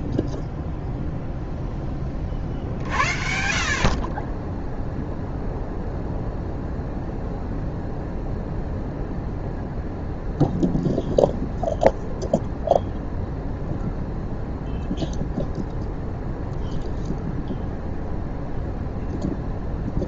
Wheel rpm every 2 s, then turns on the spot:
0, 50, 0, 0, 0, 0, 0, 0, 0, 0.
none